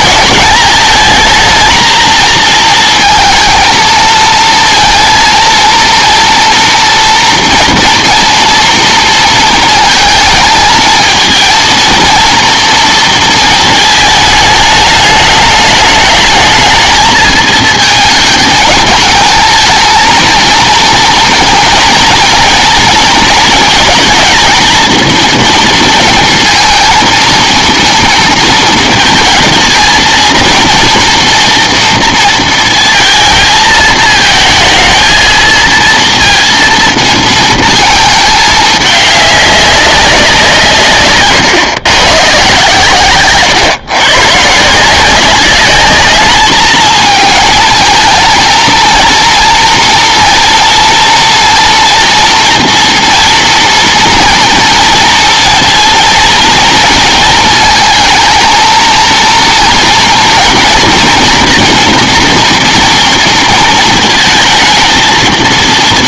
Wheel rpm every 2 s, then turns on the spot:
220, 220, 230, 230, 230, 220, 230, 210, 220, 210, 230, 230, 220, 230, 230, 230, 230, 220, 230, 210, 170, 130, 160, 220, 230, 230, 240, 230, 230, 220, 240, 230, 220.
none